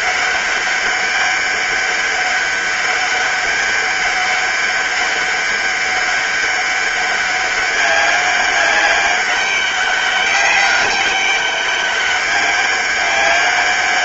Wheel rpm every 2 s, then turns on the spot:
200, 200, 190, 200, 200, 200, 200.
none